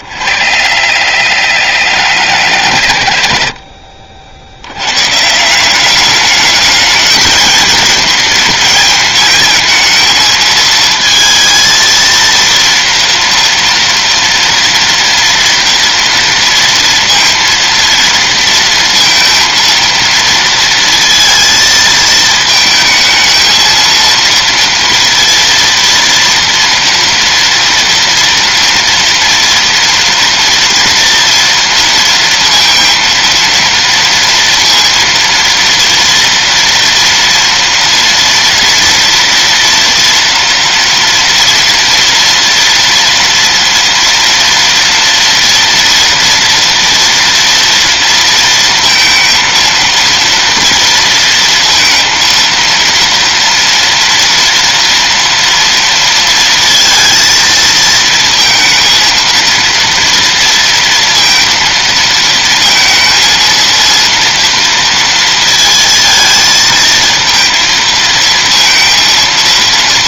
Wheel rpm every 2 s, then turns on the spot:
70, 80, 80, 210, 220, 220, 230, 230, 230, 230, 230, 220, 230, 230, 230, 230, 230, 230, 240, 230, 230, 230, 240, 230, 230, 230, 230, 230, 230, 230, 230, 230, 230, 230, 230.
none